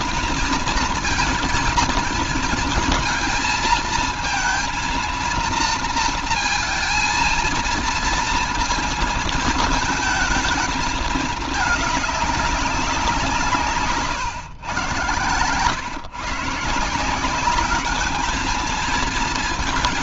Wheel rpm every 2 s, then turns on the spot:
230, 230, 230, 230, 230, 220, 190, 130, 170, 220.
none